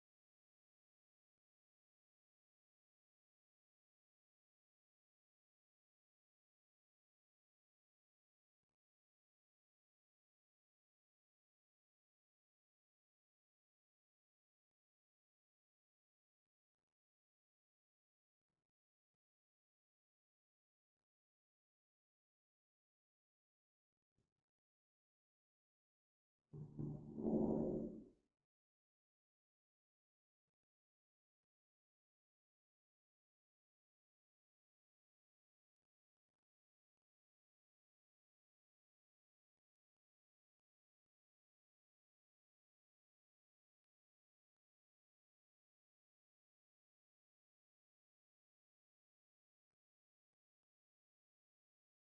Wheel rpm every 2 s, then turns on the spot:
0, 0, 0, 0, 0, 0, 0, 0, 0, 0, 0, 0, 0, 0, 0, 0, 0, 0, 0, 0, 0, 0, 0, 0, 0, 0.
none